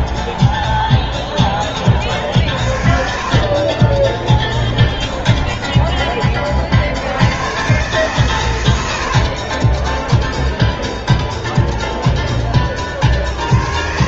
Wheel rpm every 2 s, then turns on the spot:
10, 50, 30, 50, 90, 10, 30.
0-6